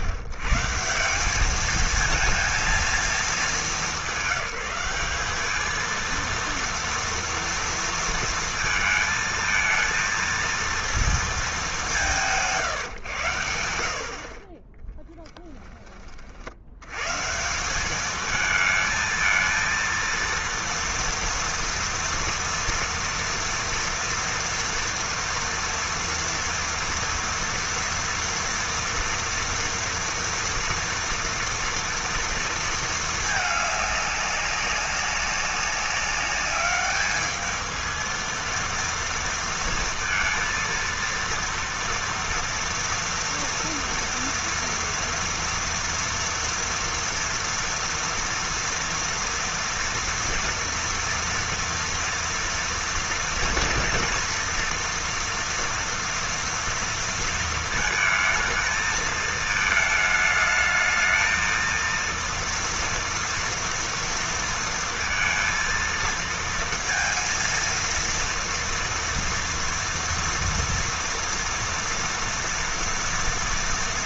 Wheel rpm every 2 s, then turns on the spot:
140, 230, 190, 230, 230, 230, 160, 30, 80, 220, 230, 230, 230, 230, 230, 230, 230, 200, 200, 230, 230, 240, 230, 230, 230, 230, 230, 230, 230, 220, 220, 230, 230, 230, 230, 230, 240.
none